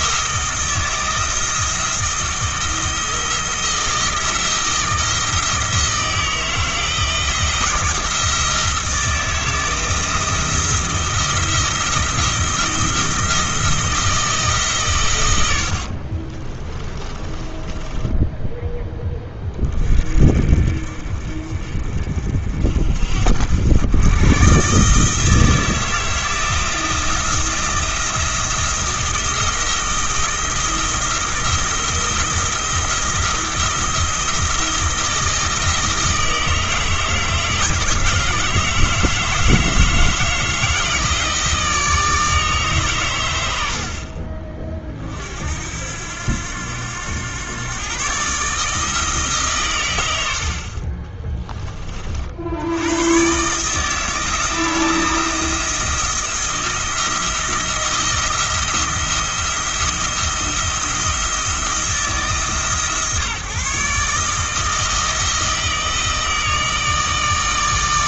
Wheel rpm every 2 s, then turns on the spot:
160, 160, 170, 160, 170, 170, 170, 140, 30, 10, 50, 60, 140, 160, 170, 170, 170, 160, 160, 160, 160, 140, 40, 90, 150, 40, 100, 160, 170, 170, 170, 150, 160, 160.
16-18